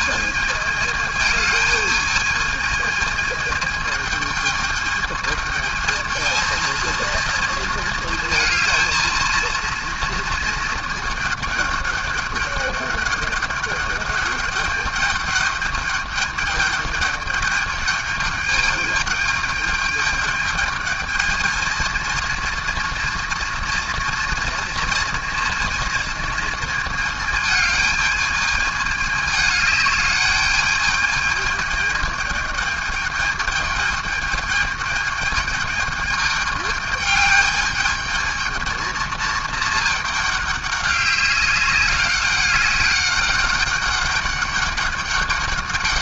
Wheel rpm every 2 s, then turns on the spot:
220, 220, 220, 230, 230, 220, 200, 210, 200, 210, 220, 230, 230, 230, 210, 210, 210, 210, 210, 220, 200, 200, 200.
none